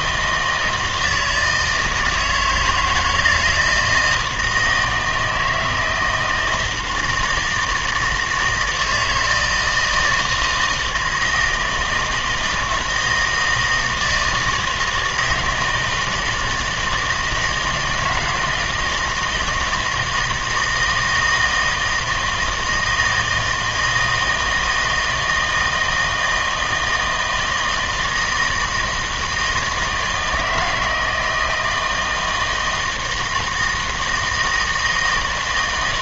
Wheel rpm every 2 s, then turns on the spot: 160, 160, 160, 170, 160, 160, 160, 160, 160, 160, 160, 160, 160, 160, 160, 160, 160, 160.
none